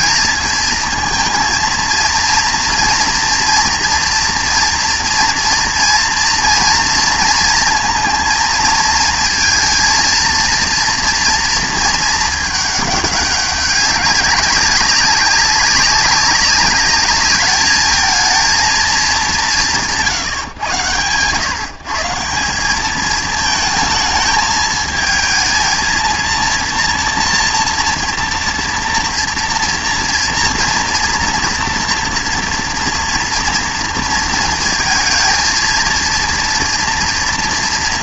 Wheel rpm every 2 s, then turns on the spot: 230, 230, 230, 230, 230, 230, 210, 190, 200, 220, 110, 200, 220, 230, 230, 230, 230, 230, 230.
none